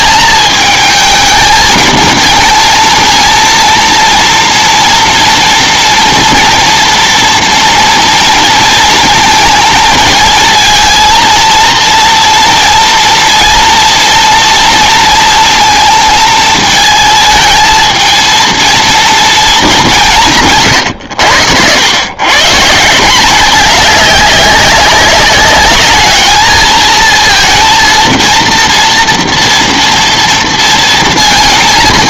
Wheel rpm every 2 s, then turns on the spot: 220, 230, 230, 230, 230, 230, 230, 230, 220, 230, 140, 150, 190, 220, 230, 230.
none